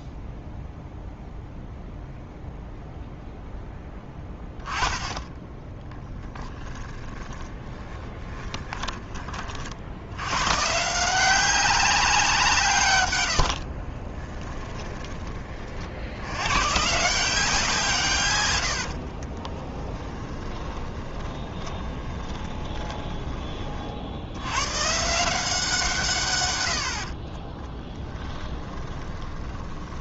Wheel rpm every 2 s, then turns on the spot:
0, 0, 10, 20, 20, 150, 140, 20, 140, 70, 30, 10, 130, 70, 20.
6-10 14-16 18-24 28-30